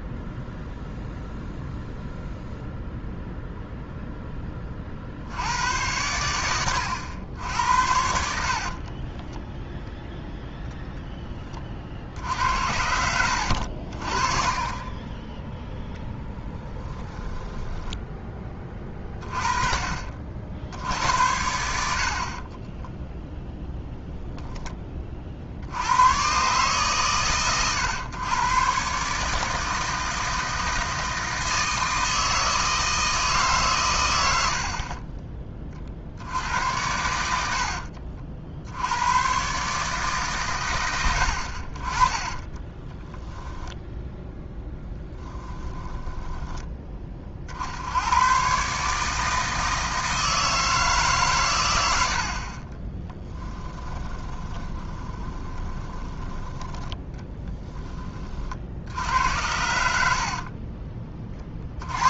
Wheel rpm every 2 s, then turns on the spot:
0, 0, 40, 90, 30, 0, 70, 20, 10, 30, 70, 10, 20, 130, 130, 160, 160, 40, 80, 80, 110, 20, 10, 20, 140, 160, 30, 20, 10, 70, 30.
8-10 12-18 22-24 42-46 52-56